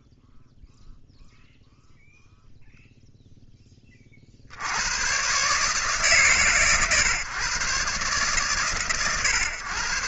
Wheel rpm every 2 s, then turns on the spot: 0, 0, 90, 140, 130.
none